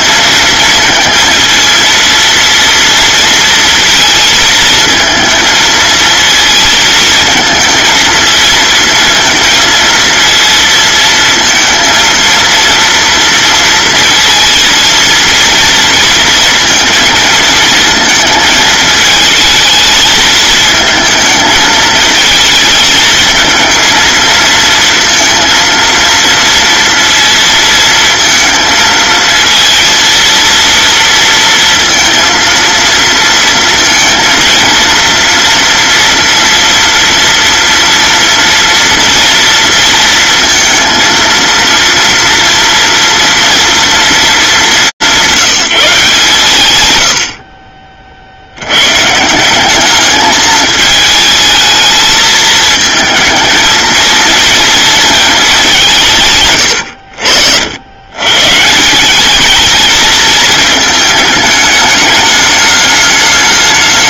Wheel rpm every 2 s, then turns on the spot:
230, 230, 230, 220, 230, 230, 230, 230, 220, 220, 220, 220, 230, 230, 220, 230, 230, 230, 230, 230, 230, 230, 160, 100, 130, 220, 220, 230, 70, 190, 220, 210.
none